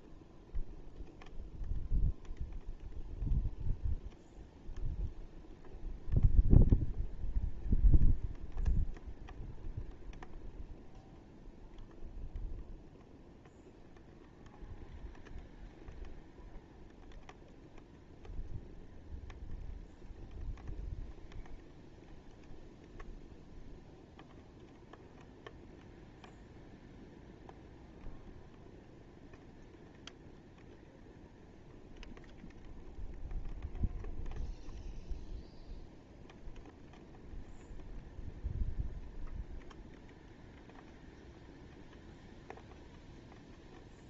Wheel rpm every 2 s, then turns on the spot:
0, 0, 0, 0, 0, 0, 0, 0, 0, 0, 0, 0, 0, 0, 0, 0, 0, 0, 0, 0, 0, 0.
none